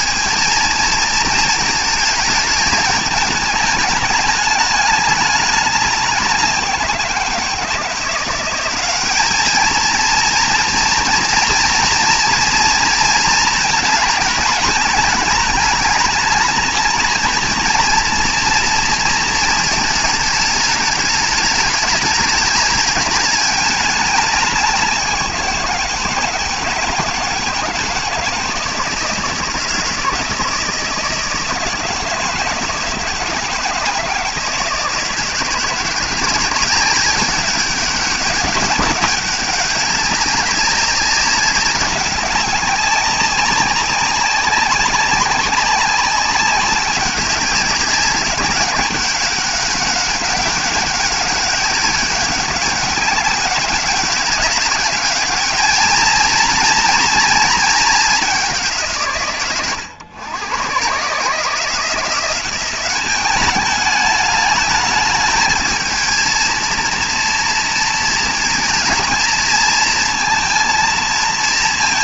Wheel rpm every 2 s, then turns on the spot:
230, 210, 210, 180, 190, 230, 240, 220, 210, 230, 210, 210, 190, 160, 160, 160, 160, 160, 180, 200, 200, 190, 190, 190, 200, 190, 200, 200, 230, 190, 120, 190, 210, 230, 230, 230.
none